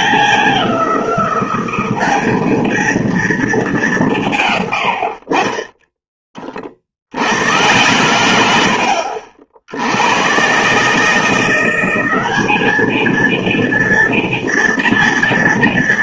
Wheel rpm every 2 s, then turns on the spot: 190, 220, 130, 40, 90, 130, 210, 230.
none